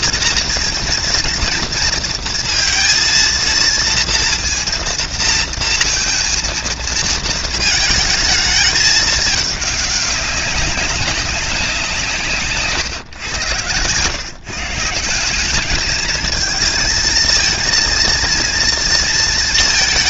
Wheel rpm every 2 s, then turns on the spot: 230, 230, 230, 220, 210, 190, 110, 190, 230, 230.
none